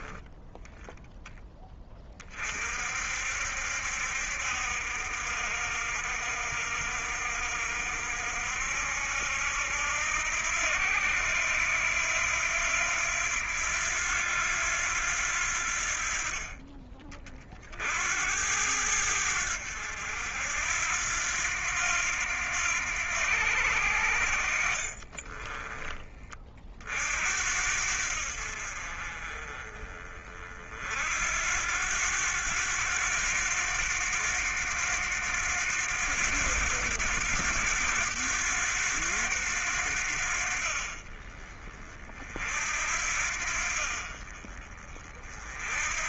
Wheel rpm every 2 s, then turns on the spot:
10, 40, 60, 60, 70, 80, 90, 90, 40, 80, 80, 90, 60, 40, 60, 50, 90, 90, 90, 100, 60, 50, 40.
24-26